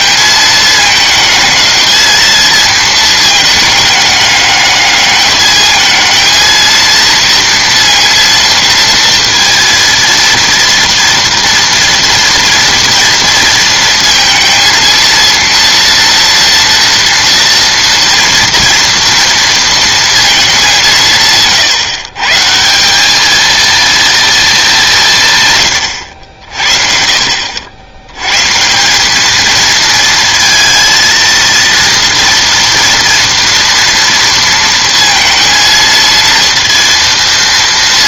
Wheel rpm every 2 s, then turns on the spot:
220, 220, 210, 230, 230, 230, 230, 230, 230, 230, 180, 180, 210, 60, 170, 230, 230, 230, 230.
none